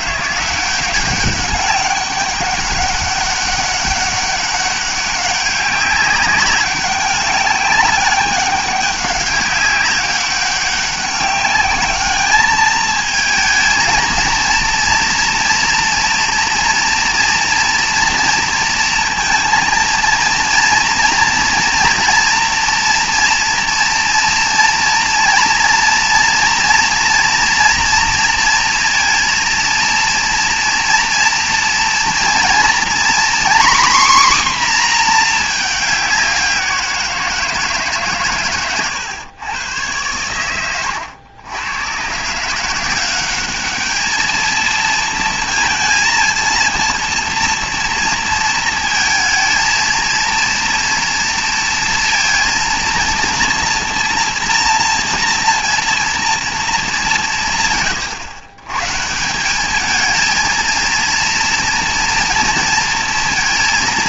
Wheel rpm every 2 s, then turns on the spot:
180, 200, 200, 200, 200, 200, 210, 230, 230, 230, 230, 230, 230, 230, 230, 230, 240, 260, 190, 120, 100, 160, 220, 230, 230, 230, 230, 230, 220, 120, 220, 230.
none